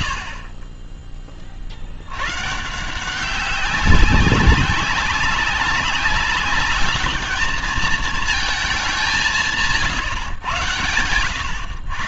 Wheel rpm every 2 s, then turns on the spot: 80, 120, 200, 200, 220, 130.
none